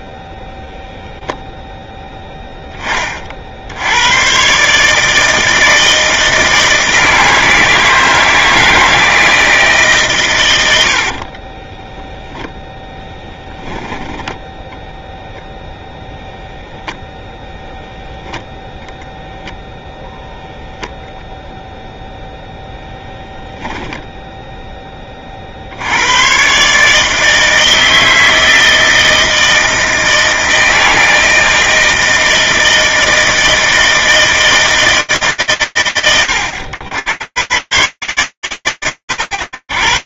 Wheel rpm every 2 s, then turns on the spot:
0, 10, 90, 160, 160, 140, 10, 10, 0, 10, 0, 0, 0, 50, 160, 160, 160, 160, 110, 120.
14-16